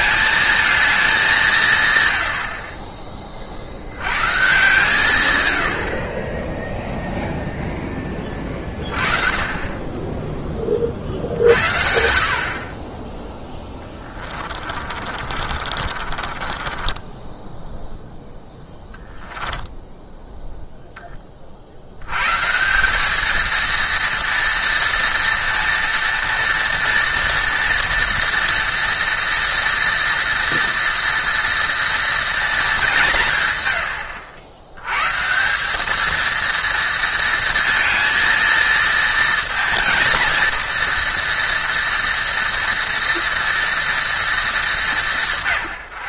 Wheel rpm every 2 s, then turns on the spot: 210, 40, 130, 0, 40, 30, 40, 30, 20, 10, 10, 180, 230, 230, 230, 230, 200, 100, 230, 230, 240, 230, 210.
14-18